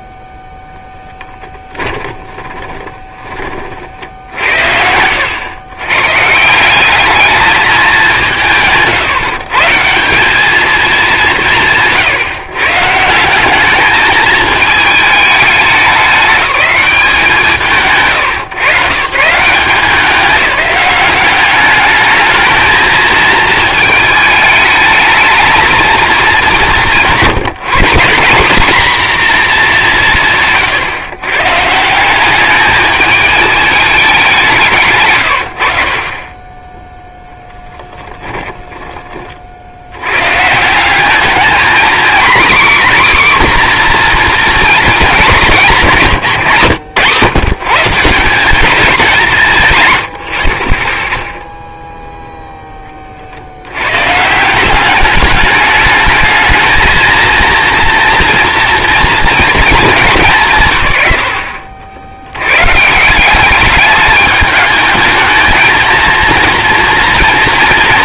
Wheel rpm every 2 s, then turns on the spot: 0, 20, 70, 170, 150, 220, 170, 220, 200, 110, 200, 220, 210, 200, 220, 130, 210, 160, 10, 30, 150, 260, 230, 120, 200, 50, 10, 180, 220, 230, 130, 130, 210, 230.
2-4 30-32 38-40 46-48